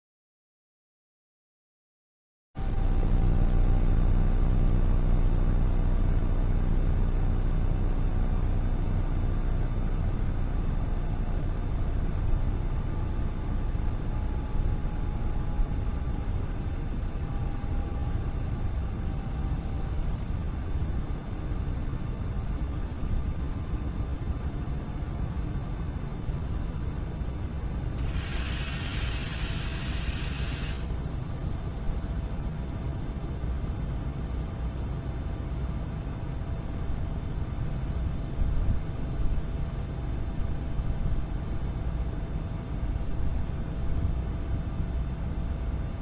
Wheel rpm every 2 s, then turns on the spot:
0, 0, 0, 0, 0, 0, 0, 0, 0, 0, 0, 0, 0, 0, 0, 0, 0, 0, 0, 0, 0, 0, 0.
none